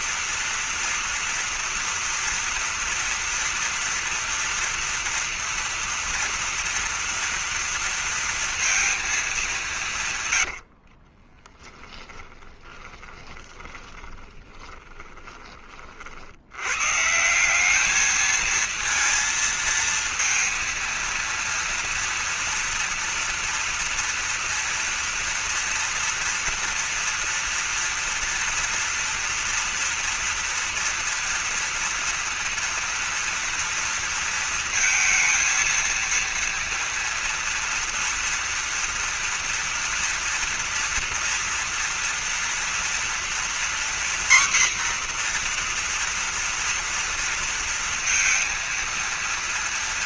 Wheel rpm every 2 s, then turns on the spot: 230, 230, 240, 230, 230, 70, 20, 20, 100, 220, 230, 230, 230, 230, 230, 230, 230, 230, 230, 230, 230, 230, 250, 230, 230.
10-16